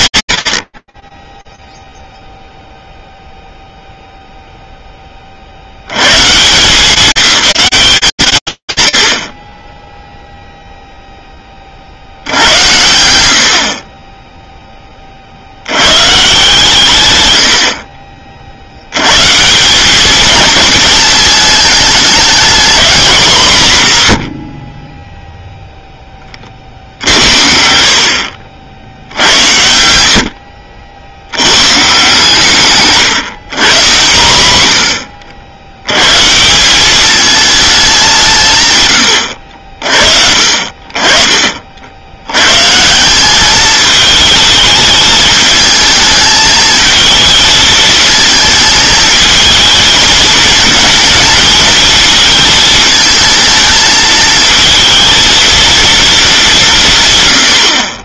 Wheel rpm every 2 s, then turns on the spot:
70, 0, 0, 180, 150, 0, 90, 20, 130, 100, 220, 210, 10, 70, 80, 70, 150, 80, 200, 120, 40, 180, 220, 220, 220, 230, 220, 220, 130.
none